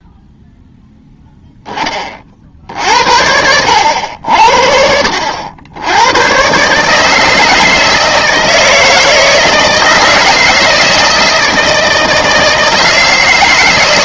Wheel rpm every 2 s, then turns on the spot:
0, 60, 60, 130, 160, 160, 160.
none